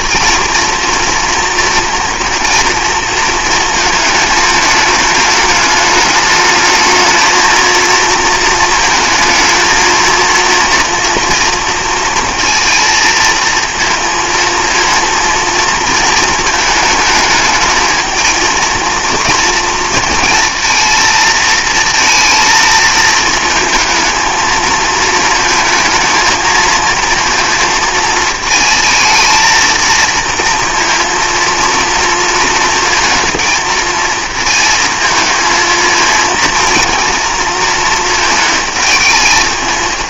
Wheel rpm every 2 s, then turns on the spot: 230, 230, 210, 220, 220, 230, 230, 230, 220, 230, 230, 220, 220, 230, 220, 230, 230, 220, 230, 220.
none